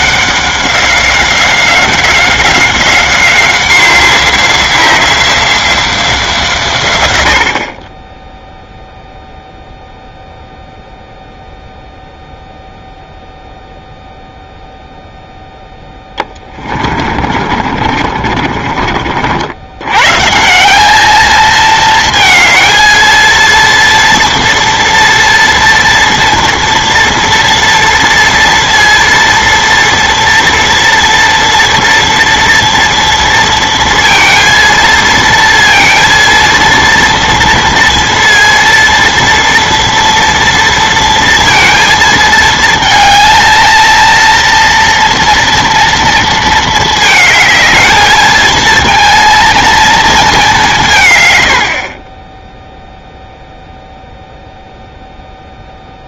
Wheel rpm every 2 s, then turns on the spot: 190, 190, 180, 130, 0, 0, 0, 0, 30, 50, 200, 230, 230, 230, 230, 230, 230, 230, 230, 230, 230, 230, 230, 220, 230, 160, 0, 0.
16-18